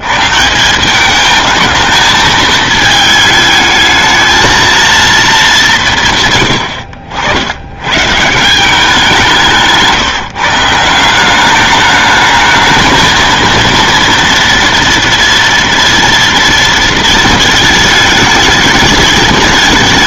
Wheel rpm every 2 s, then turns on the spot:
180, 220, 220, 80, 170, 160, 210, 230, 230, 210.
6-8